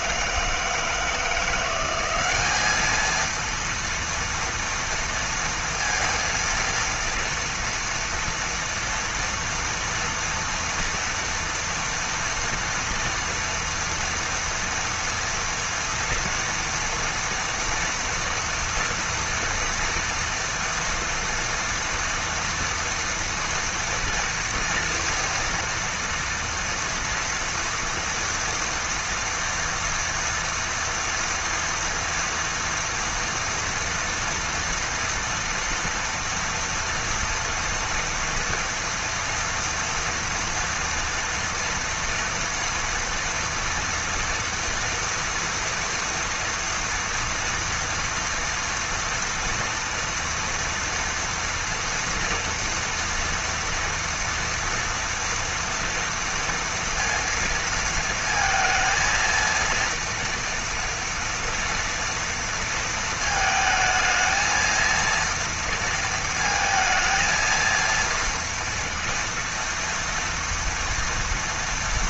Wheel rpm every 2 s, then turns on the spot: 160, 190, 230, 230, 230, 240, 230, 230, 240, 230, 230, 240, 230, 230, 230, 230, 240, 230, 230, 230, 230, 230, 240, 230, 230, 240, 240, 230, 230, 230, 230, 230, 220, 230, 230, 230.
none